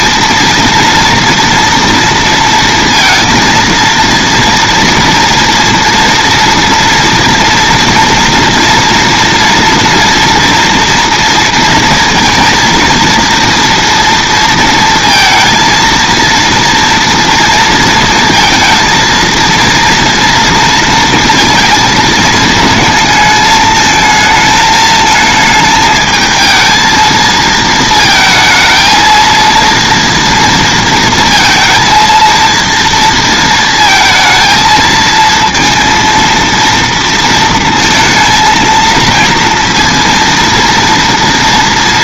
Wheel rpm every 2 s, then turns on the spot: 230, 230, 230, 240, 230, 230, 230, 230, 230, 230, 230, 220, 220, 220, 220, 230, 230, 230, 230, 230, 230.
none